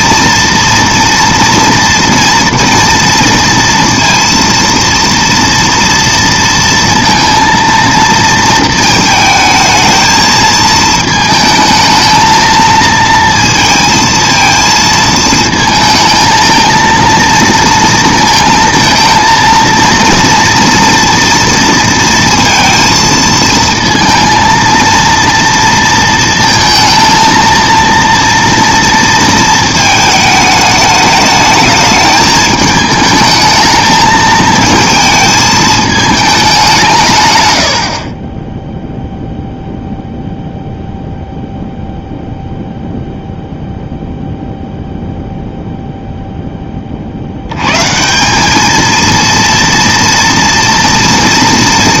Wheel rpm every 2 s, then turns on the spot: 230, 230, 230, 230, 220, 220, 230, 220, 230, 230, 230, 230, 230, 230, 230, 210, 220, 220, 150, 0, 0, 0, 0, 40, 230, 240.
none